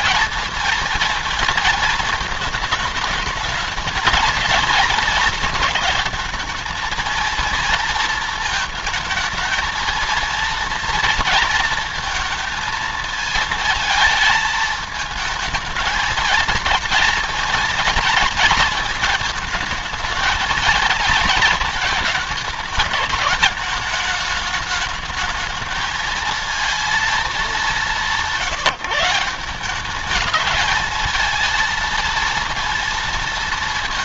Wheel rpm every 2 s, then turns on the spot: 230, 220, 220, 230, 220, 230, 220, 220, 220, 230, 220, 210, 220, 230, 170, 210, 230.
none